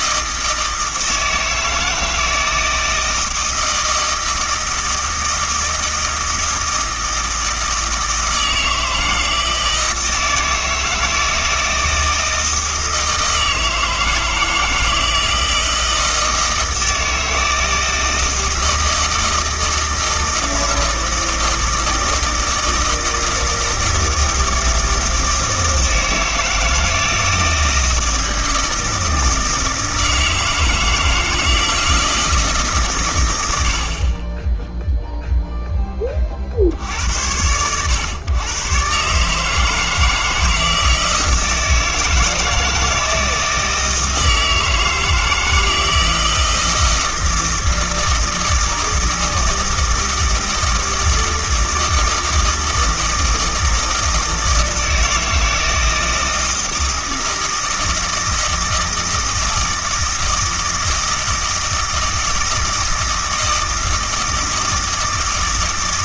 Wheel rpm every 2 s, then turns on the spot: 160, 160, 160, 160, 160, 160, 160, 160, 160, 160, 160, 160, 160, 160, 160, 160, 140, 0, 60, 120, 160, 160, 160, 160, 160, 160, 160, 160, 160, 160, 160, 160, 160.
none